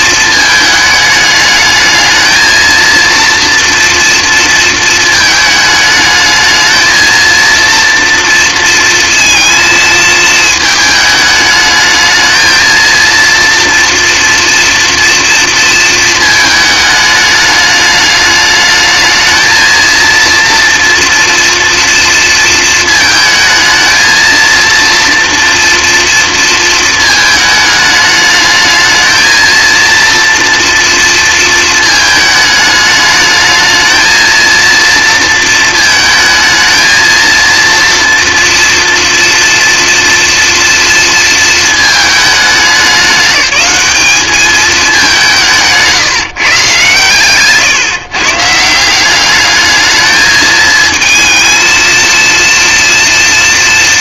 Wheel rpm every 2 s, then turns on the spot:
220, 230, 230, 220, 230, 220, 230, 230, 220, 210, 230, 230, 230, 230, 220, 230, 220, 230, 220, 230, 240, 200, 200, 130, 180, 220, 230.
none